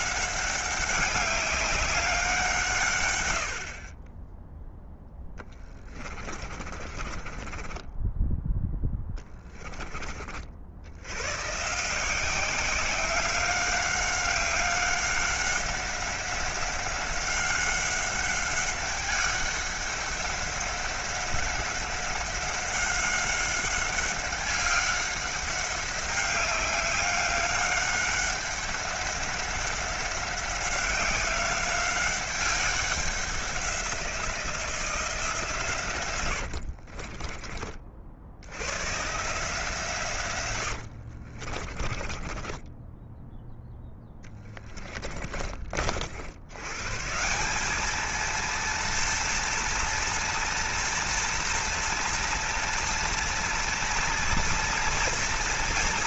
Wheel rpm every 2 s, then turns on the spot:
190, 150, 10, 30, 10, 60, 180, 190, 190, 200, 190, 190, 200, 190, 190, 190, 190, 170, 70, 100, 80, 10, 20, 110, 230, 230, 230, 230.
6-10 36-38 40-46